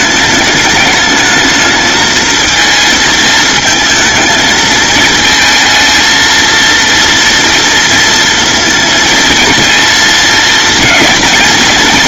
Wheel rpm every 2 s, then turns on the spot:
210, 220, 220, 230, 230, 230.
none